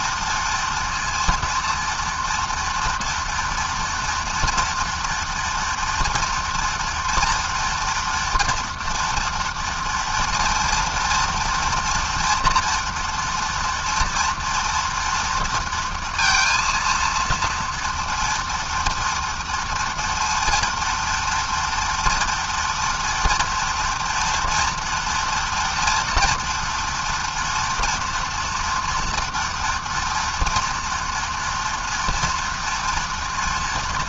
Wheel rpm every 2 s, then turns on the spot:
230, 230, 230, 230, 240, 230, 240, 230, 230, 230, 230, 240, 230, 230, 240, 230, 230.
none